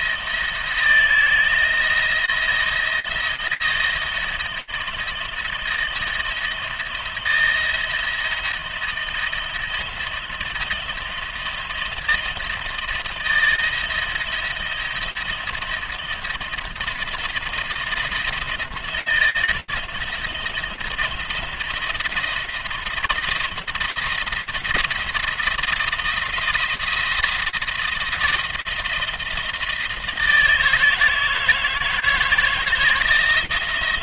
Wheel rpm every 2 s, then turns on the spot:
160, 170, 160, 160, 160, 170, 170, 170, 170, 170, 170, 170, 160, 170, 170, 160, 160.
none